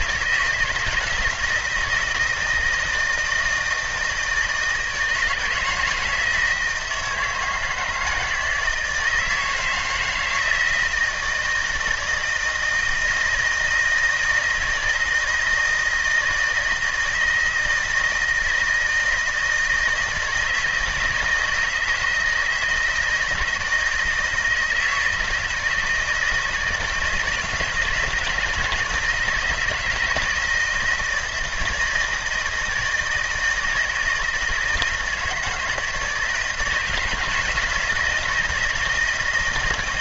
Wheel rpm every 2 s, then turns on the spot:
160, 160, 160, 160, 160, 160, 160, 160, 160, 160, 160, 160, 160, 160, 170, 160, 160, 160, 160, 170.
none